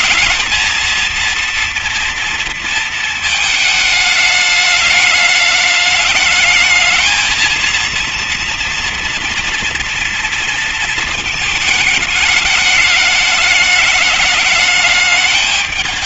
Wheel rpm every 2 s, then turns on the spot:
230, 240, 210, 210, 230, 230, 220, 210.
none